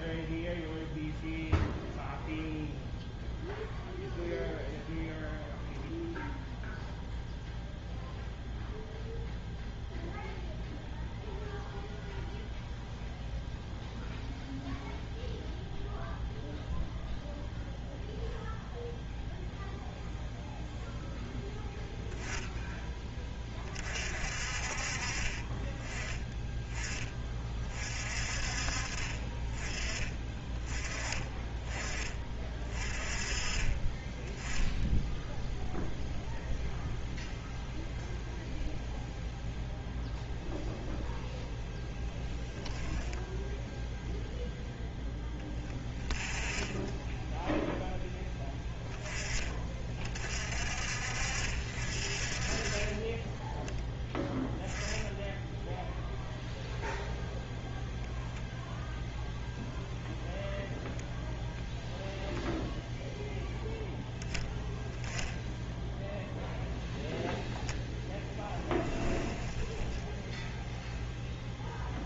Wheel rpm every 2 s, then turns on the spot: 0, 0, 0, 0, 0, 0, 0, 0, 0, 0, 0, 10, 40, 10, 40, 20, 30, 10, 0, 0, 0, 10, 0, 10, 20, 50, 30, 10, 0, 0, 0, 0, 0, 0, 10, 0.
68-70